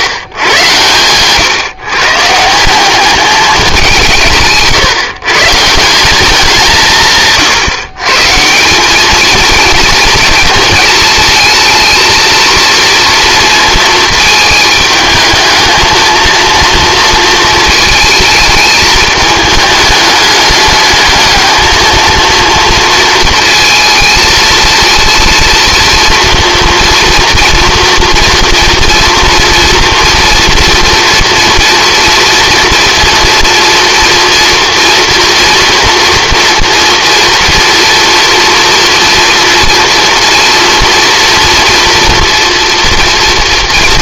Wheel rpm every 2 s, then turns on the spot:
110, 190, 150, 170, 210, 220, 230, 220, 230, 220, 210, 230, 230, 230, 230, 230, 230, 240, 240, 230, 230, 230.
none